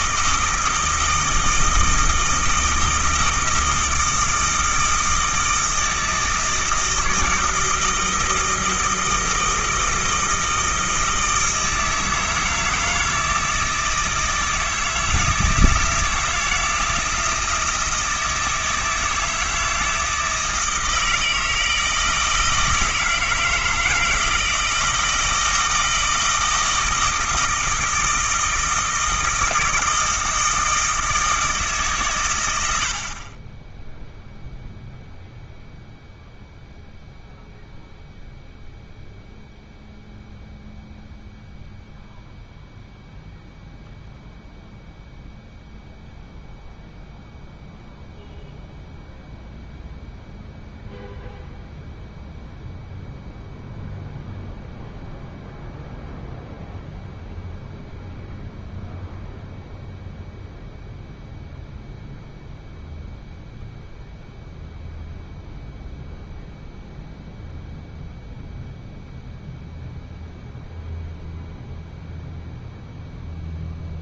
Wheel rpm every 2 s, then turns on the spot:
160, 160, 160, 160, 160, 160, 160, 160, 170, 160, 160, 160, 160, 160, 160, 160, 70, 0, 0, 0, 0, 0, 0, 0, 0, 0, 0, 0, 0, 0, 0, 0, 0, 0, 0, 0, 0.
none